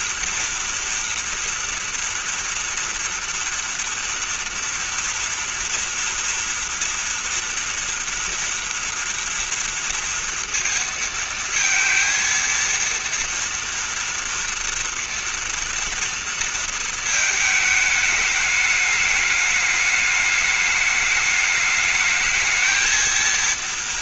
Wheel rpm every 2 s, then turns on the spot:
230, 240, 240, 230, 240, 230, 230, 230, 230, 210, 210, 230.
none